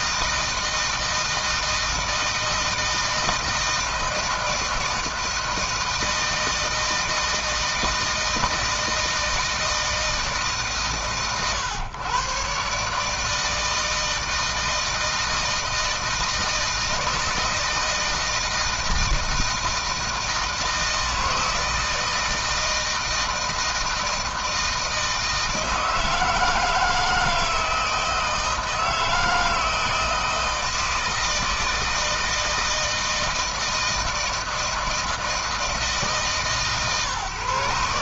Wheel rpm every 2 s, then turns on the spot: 160, 160, 160, 160, 160, 130, 140, 160, 170, 160, 160, 160, 160, 160, 160, 160, 160, 160, 150.
none